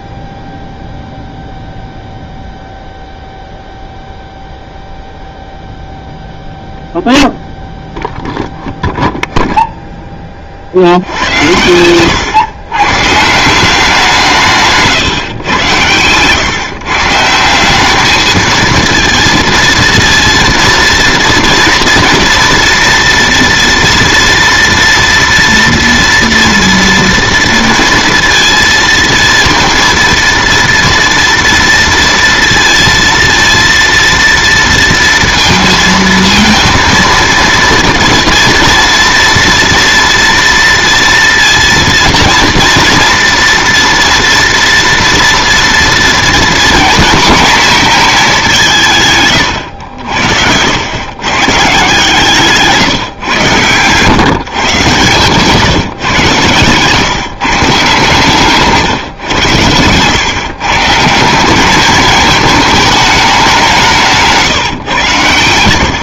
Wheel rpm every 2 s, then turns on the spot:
0, 0, 0, 0, 0, 70, 130, 140, 140, 230, 230, 230, 230, 230, 230, 230, 230, 230, 230, 230, 230, 230, 230, 240, 160, 110, 140, 130, 130, 150, 150, 210, 130.
14-16 54-56